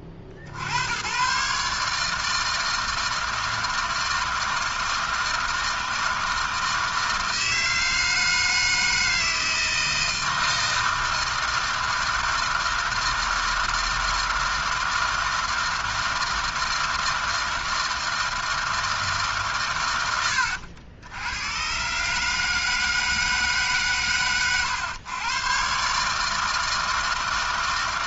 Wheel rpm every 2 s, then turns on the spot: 90, 160, 160, 160, 160, 160, 160, 160, 160, 160, 90, 160, 120, 160.
none